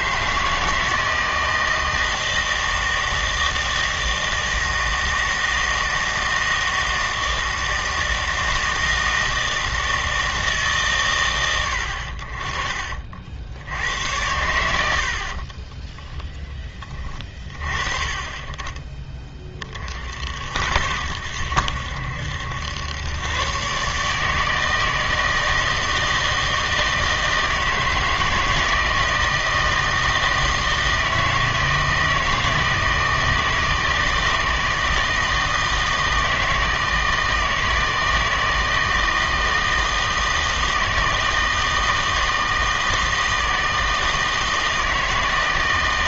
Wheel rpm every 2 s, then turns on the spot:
160, 160, 160, 160, 160, 150, 40, 90, 20, 20, 70, 100, 160, 160, 160, 160, 160, 160, 160, 160, 160, 160, 160.
none